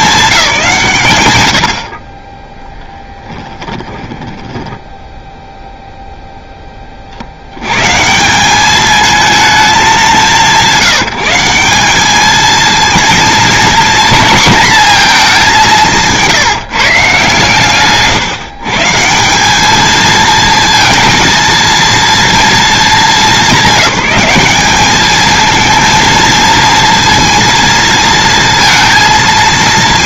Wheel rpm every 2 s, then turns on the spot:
190, 10, 10, 20, 210, 180, 230, 230, 150, 150, 230, 210, 210, 230, 230.
4-6